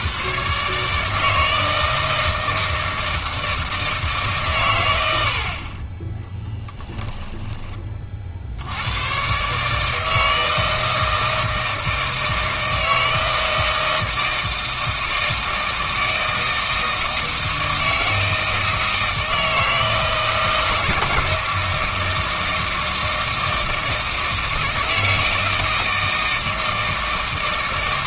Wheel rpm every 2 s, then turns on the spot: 140, 160, 130, 10, 80, 160, 160, 160, 160, 160, 160, 160, 160, 160.
6-8